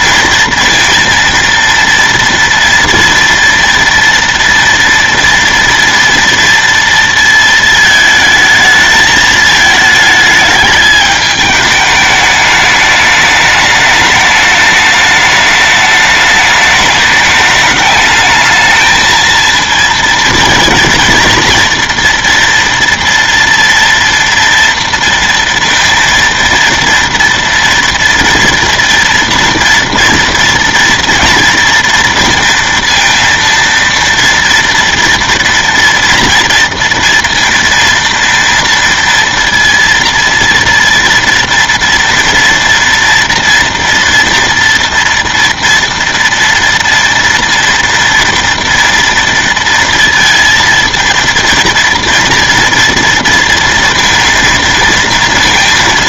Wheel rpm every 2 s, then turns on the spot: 230, 230, 230, 230, 220, 210, 210, 210, 210, 220, 230, 230, 230, 230, 230, 230, 230, 230, 230, 230, 230, 230, 230, 230, 230, 230, 230, 230.
none